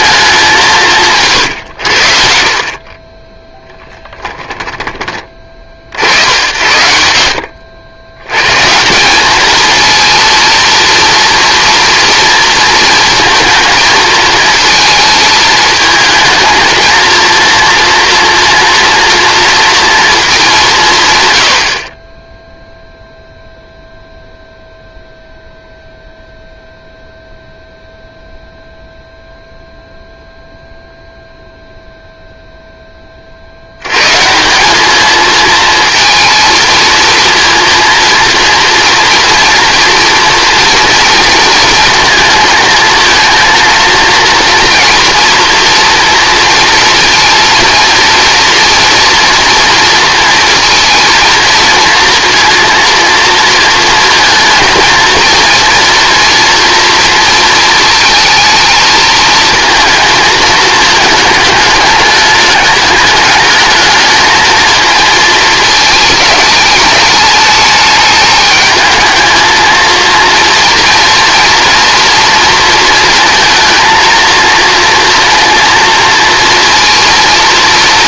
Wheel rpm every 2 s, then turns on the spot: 180, 50, 20, 80, 140, 230, 230, 220, 230, 230, 180, 0, 0, 0, 0, 0, 0, 190, 220, 230, 240, 230, 230, 230, 230, 230, 230, 230, 230, 220, 220, 210, 230, 210, 220, 230, 230, 230, 230.
none